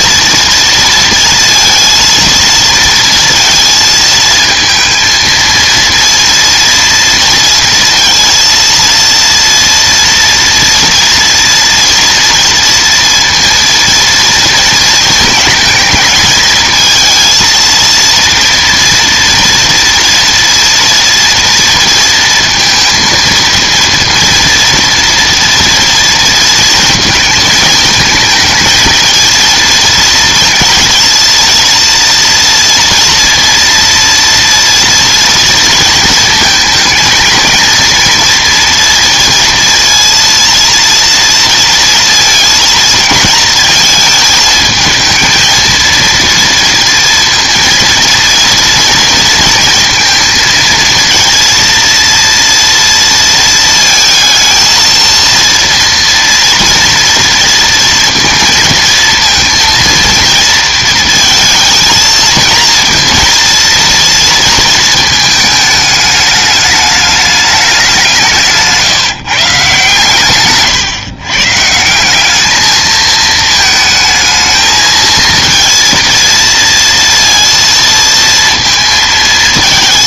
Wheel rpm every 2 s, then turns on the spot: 230, 230, 220, 230, 230, 230, 230, 230, 220, 230, 230, 230, 230, 230, 230, 230, 230, 230, 220, 230, 230, 220, 220, 230, 230, 230, 230, 230, 230, 230, 220, 230, 230, 210, 160, 140, 210, 220, 230, 230.
none